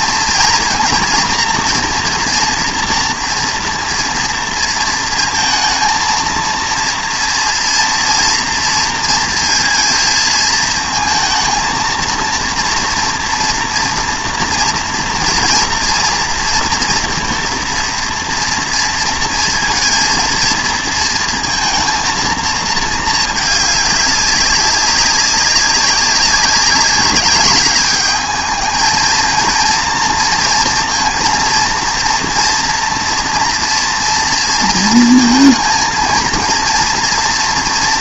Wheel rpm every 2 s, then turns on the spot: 230, 240, 230, 230, 230, 230, 230, 230, 230, 230, 230, 220, 200, 200, 220, 230, 230, 230, 230.
none